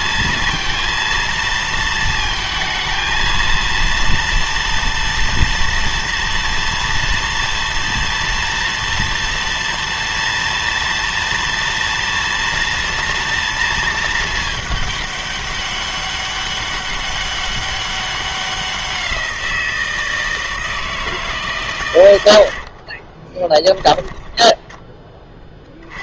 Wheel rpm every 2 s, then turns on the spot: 230, 220, 230, 230, 230, 230, 230, 210, 200, 190, 160, 50, 20.
22-24